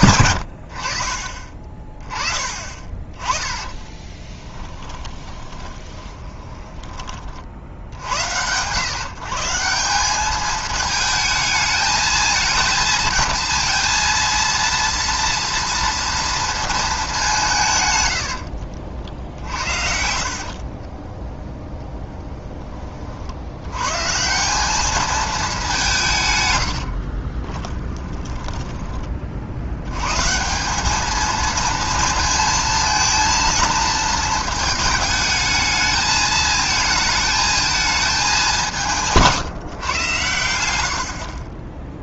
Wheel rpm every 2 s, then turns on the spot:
60, 20, 10, 10, 120, 220, 220, 230, 230, 80, 30, 30, 200, 80, 10, 190, 230, 220, 220, 180, 80.
2-8 18-22 26-30